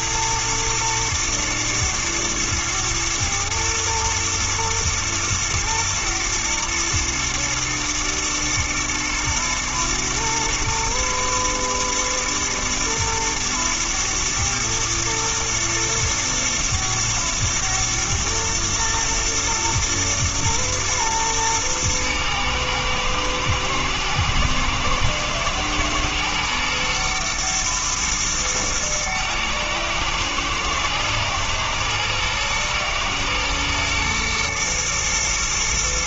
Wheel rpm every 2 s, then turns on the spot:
110, 110, 110, 110, 120, 110, 120, 110, 120, 110, 110, 110, 110, 120, 110, 110, 110, 120.
none